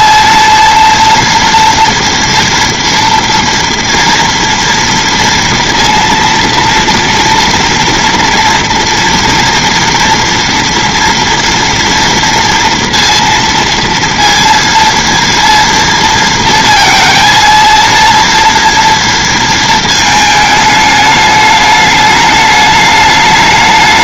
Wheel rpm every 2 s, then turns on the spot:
230, 230, 230, 230, 230, 230, 230, 230, 230, 230, 210, 210.
none